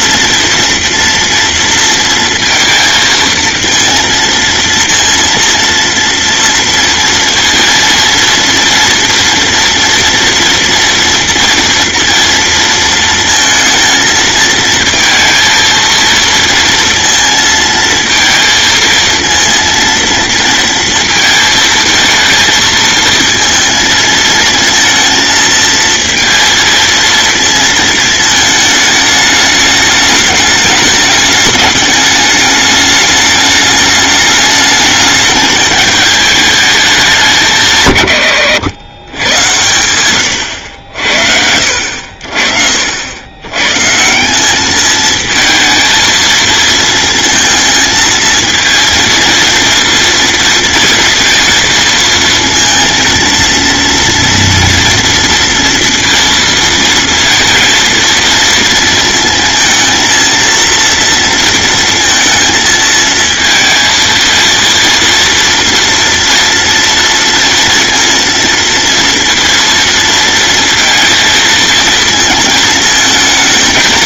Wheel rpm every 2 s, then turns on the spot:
230, 230, 230, 230, 230, 230, 230, 220, 230, 230, 220, 220, 230, 230, 220, 210, 210, 210, 200, 110, 80, 60, 210, 230, 230, 230, 230, 230, 230, 230, 230, 220, 230, 230, 230, 230, 220.
none